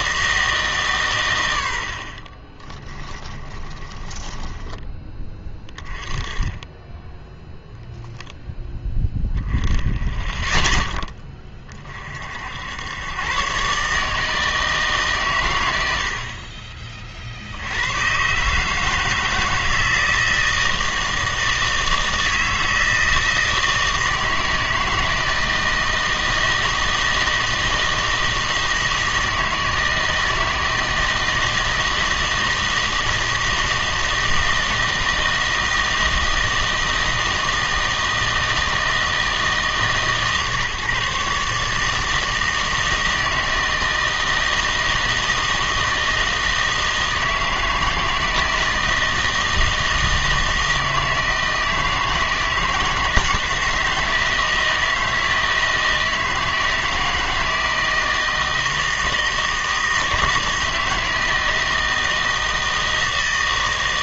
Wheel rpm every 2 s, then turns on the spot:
150, 30, 20, 20, 10, 10, 100, 150, 30, 150, 160, 160, 160, 160, 160, 160, 160, 160, 160, 160, 150, 160, 160, 160, 160, 160, 160, 160, 160, 160, 160, 160.
2-4